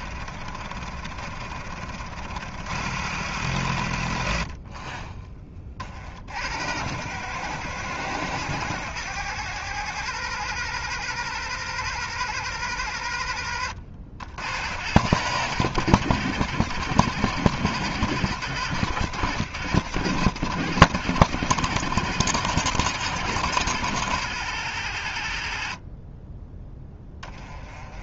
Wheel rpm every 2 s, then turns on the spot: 60, 100, 40, 90, 120, 130, 110, 90, 100, 100, 110, 100, 90, 10.
26-28